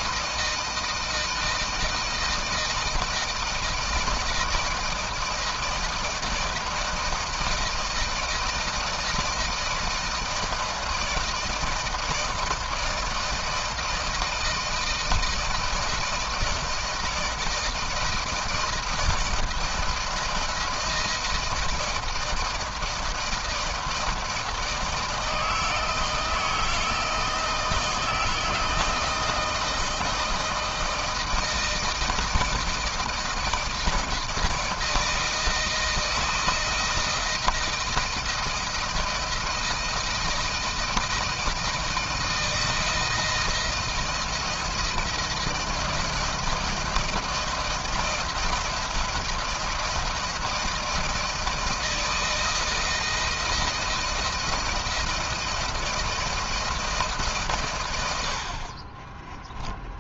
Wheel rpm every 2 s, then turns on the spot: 160, 160, 160, 160, 160, 160, 160, 160, 160, 160, 160, 160, 160, 160, 160, 160, 160, 160, 160, 170, 160, 160, 170, 160, 160, 160, 160, 160, 170, 60.
58-60